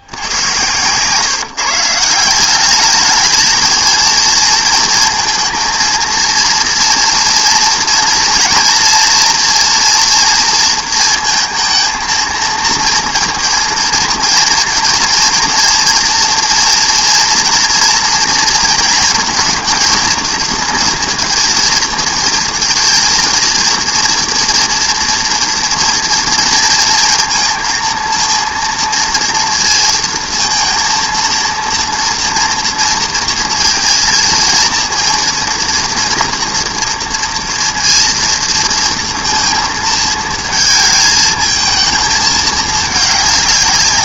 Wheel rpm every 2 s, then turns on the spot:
120, 200, 220, 230, 240, 230, 220, 230, 230, 230, 230, 230, 230, 230, 230, 230, 230, 230, 240, 230, 230, 210.
none